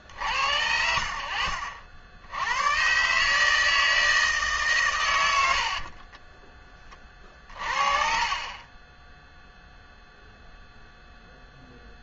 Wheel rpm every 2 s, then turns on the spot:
70, 120, 120, 20, 20, 0.
6-10